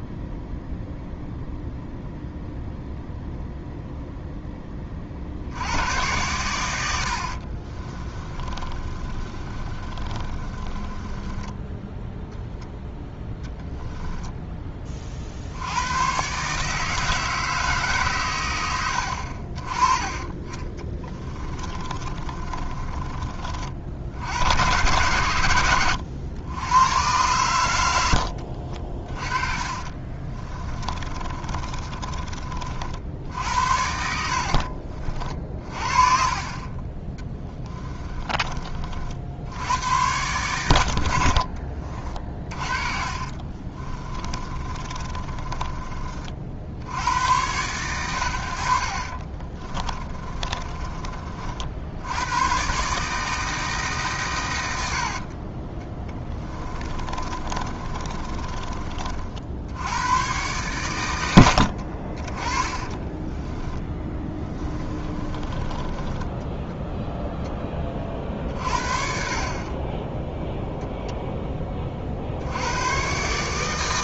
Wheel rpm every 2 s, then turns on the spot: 0, 0, 30, 90, 30, 20, 0, 20, 150, 70, 20, 30, 100, 100, 40, 20, 50, 60, 30, 40, 80, 40, 30, 70, 60, 30, 130, 100, 20, 30, 110, 20, 20, 10, 50, 0, 100.
8-12 20-24 28-32 34-38 42-46 56-58 62-66